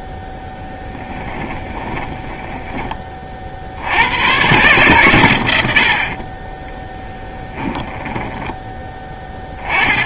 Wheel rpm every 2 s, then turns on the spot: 10, 20, 100, 20, 10.
0-2 6-8